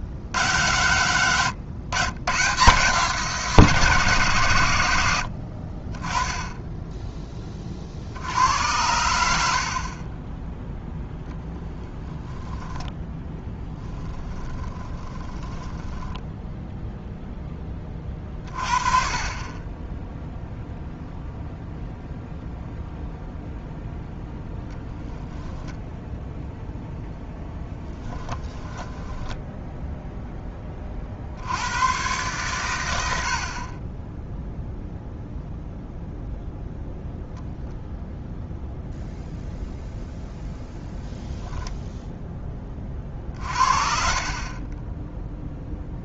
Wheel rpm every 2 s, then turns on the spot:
120, 150, 20, 40, 40, 20, 10, 10, 20, 20, 0, 0, 10, 10, 0, 90, 40, 0, 10, 0, 0, 40, 10.
10-16 26-28